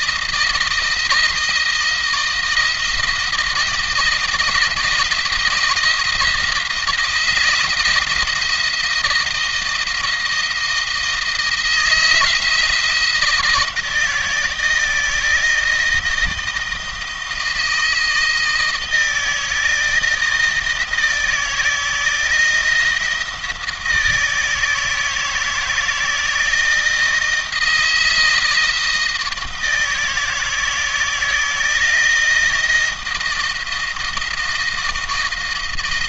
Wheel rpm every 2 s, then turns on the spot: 160, 160, 170, 160, 170, 160, 160, 170, 160, 160, 160, 160, 160, 160, 160, 160, 160, 160.
none